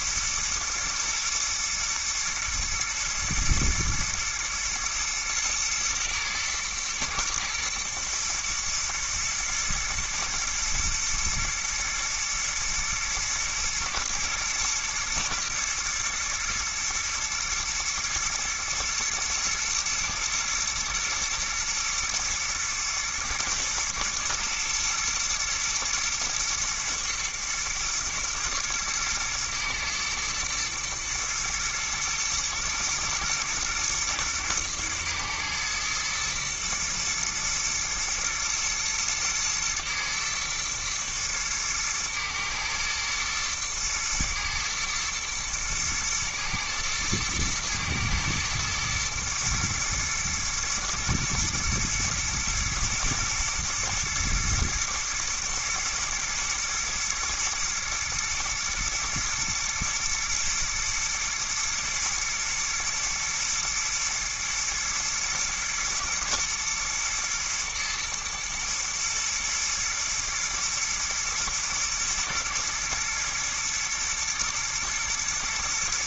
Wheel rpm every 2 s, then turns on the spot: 110, 120, 110, 120, 120, 120, 120, 110, 110, 120, 120, 110, 110, 110, 110, 110, 120, 110, 110, 120, 110, 110, 120, 120, 110, 120, 110, 110, 110, 120, 120, 110, 110, 110, 110, 120, 110, 120.
none